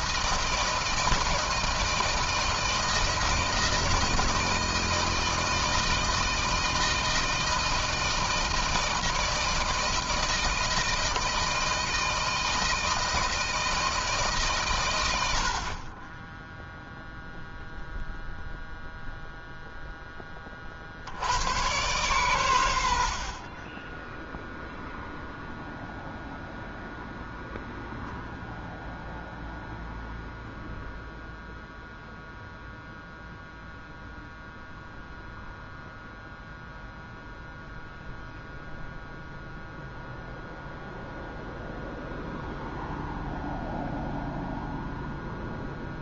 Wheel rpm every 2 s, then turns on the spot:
170, 160, 160, 160, 160, 160, 160, 120, 0, 0, 60, 80, 0, 0, 0, 0, 0, 0, 0, 0, 0, 0, 0.
none